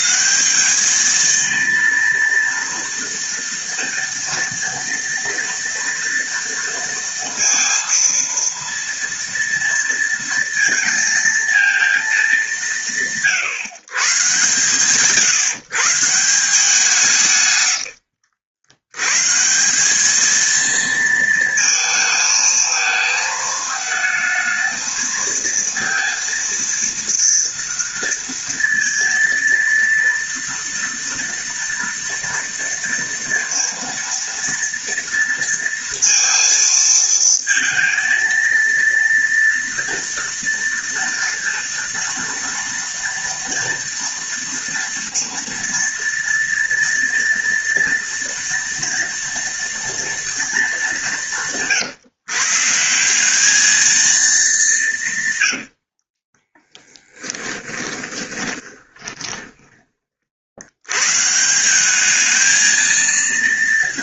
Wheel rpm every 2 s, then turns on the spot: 220, 230, 230, 230, 230, 230, 150, 130, 150, 130, 230, 220, 230, 230, 230, 240, 230, 230, 230, 230, 230, 230, 230, 230, 230, 180, 190, 130, 10, 20, 140, 230.
54-60